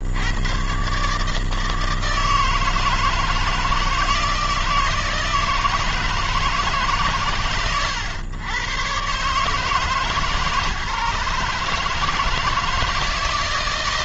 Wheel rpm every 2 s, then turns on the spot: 140, 160, 160, 140, 110, 150, 160.
none